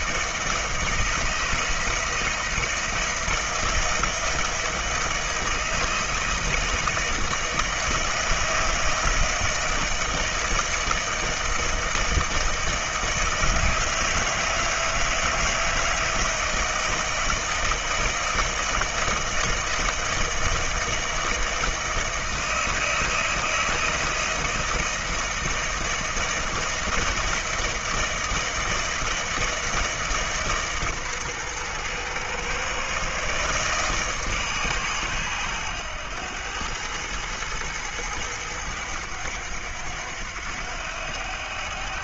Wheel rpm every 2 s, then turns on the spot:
160, 160, 160, 160, 160, 160, 160, 160, 160, 160, 160, 160, 160, 160, 160, 140, 120, 130, 100, 100, 90.
none